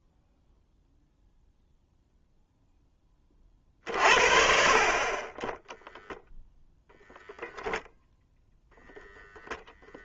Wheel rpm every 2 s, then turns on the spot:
0, 10, 40, 10, 0.
none